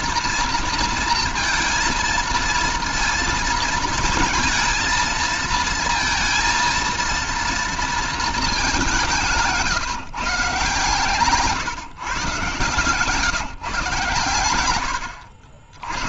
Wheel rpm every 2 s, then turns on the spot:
230, 230, 230, 230, 200, 140, 140, 100.
none